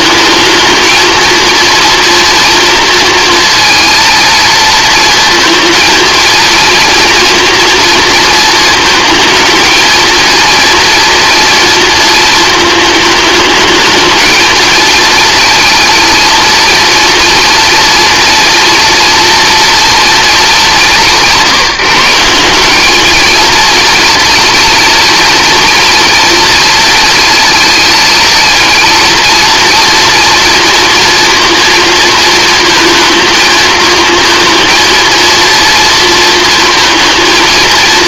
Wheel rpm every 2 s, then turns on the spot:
220, 230, 230, 230, 220, 230, 220, 230, 240, 230, 200, 200, 230, 230, 230, 230, 230, 230, 230.
none